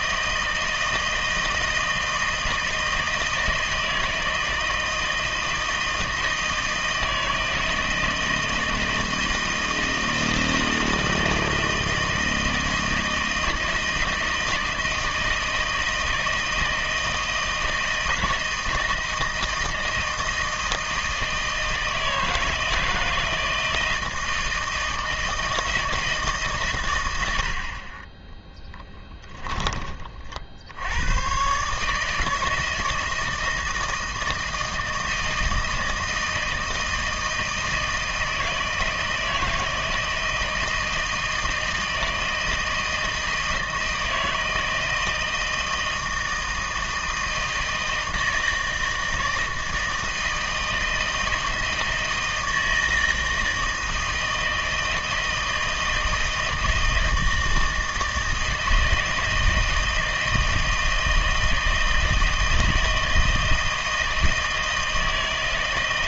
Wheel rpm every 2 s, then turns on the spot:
160, 160, 160, 160, 160, 160, 160, 160, 160, 160, 160, 160, 160, 130, 10, 80, 160, 160, 160, 160, 160, 160, 160, 160, 160, 160, 160, 160, 160, 160, 160, 160, 160.
28-30